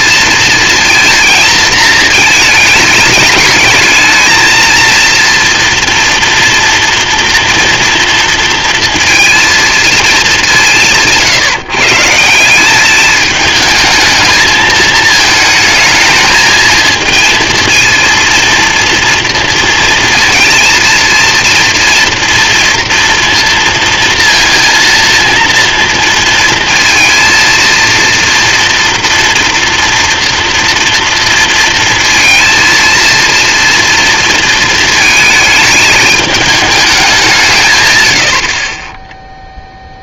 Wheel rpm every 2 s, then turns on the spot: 230, 210, 220, 230, 230, 190, 180, 220, 220, 230, 230, 230, 230, 230, 230, 230, 230, 230, 210, 50.
none